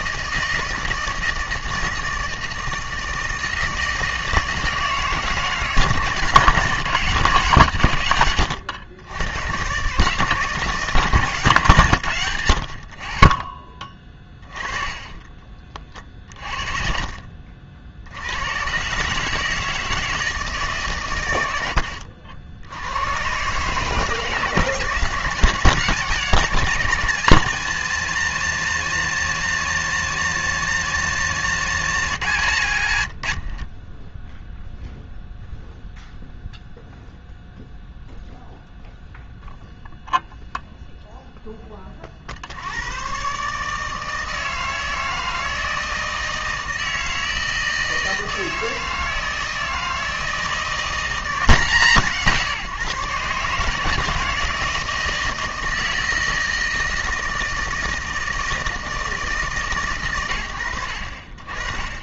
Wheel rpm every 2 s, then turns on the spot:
160, 160, 160, 170, 110, 150, 40, 20, 40, 150, 120, 120, 170, 170, 190, 180, 70, 0, 0, 0, 0, 110, 160, 160, 160, 180, 150, 170, 160, 160, 50.
14-16 32-34